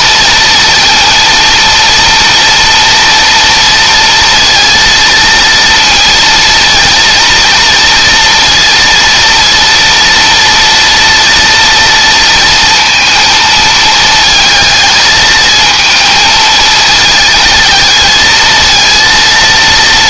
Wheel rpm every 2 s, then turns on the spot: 230, 240, 230, 230, 230, 230, 230, 220, 230, 230.
none